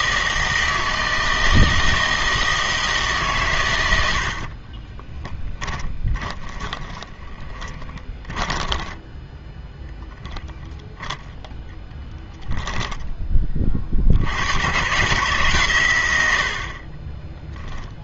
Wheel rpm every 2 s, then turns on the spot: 160, 160, 40, 10, 10, 0, 10, 120, 70.
4-10 12-14